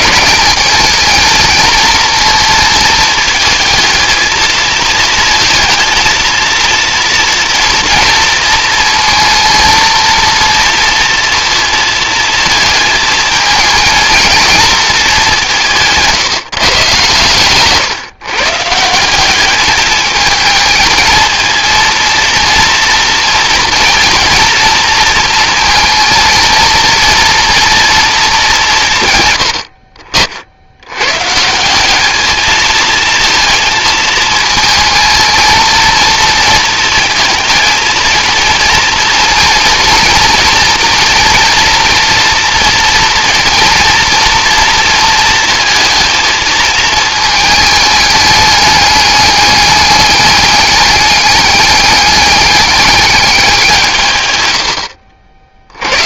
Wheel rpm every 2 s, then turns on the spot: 220, 230, 230, 230, 230, 230, 220, 220, 140, 160, 220, 230, 230, 230, 150, 100, 220, 230, 230, 230, 230, 230, 230, 220, 210, 210, 210, 80.
none